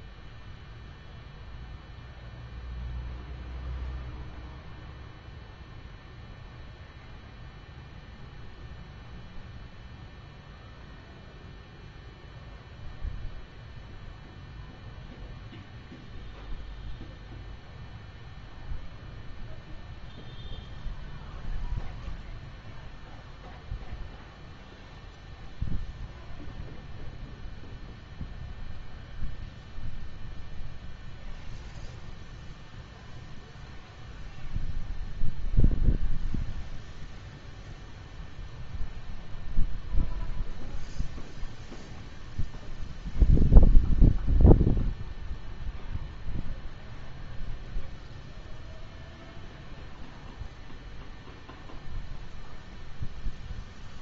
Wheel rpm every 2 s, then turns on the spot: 0, 0, 0, 0, 0, 0, 0, 0, 0, 0, 0, 0, 0, 0, 0, 0, 0, 0, 0, 0, 0, 0, 0, 0, 0, 0, 0.
none